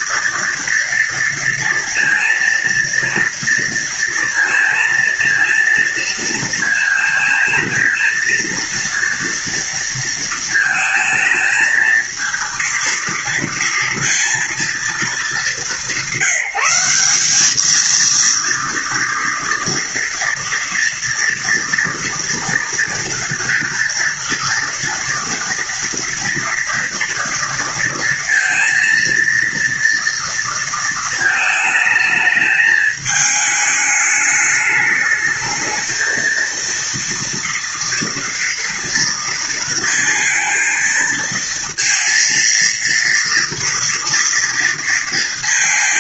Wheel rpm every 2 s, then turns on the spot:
240, 230, 230, 230, 230, 230, 230, 230, 180, 230, 230, 230, 230, 230, 230, 230, 220, 210, 230, 230, 230, 230, 230.
none